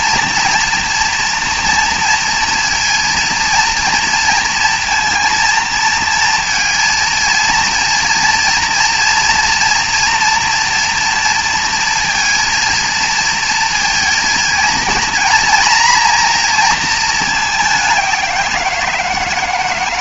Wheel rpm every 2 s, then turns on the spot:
240, 230, 230, 230, 230, 230, 230, 230, 230, 170.
none